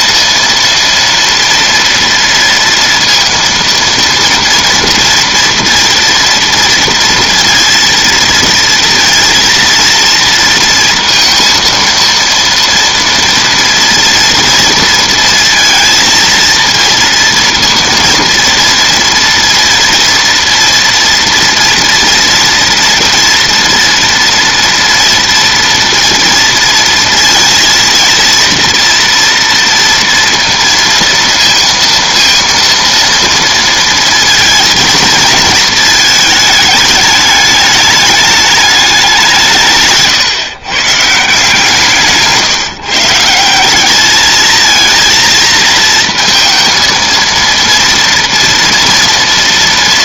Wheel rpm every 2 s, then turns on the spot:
230, 230, 230, 230, 230, 230, 230, 230, 230, 230, 230, 230, 230, 230, 230, 230, 230, 230, 210, 200, 140, 150, 230, 230, 230.
none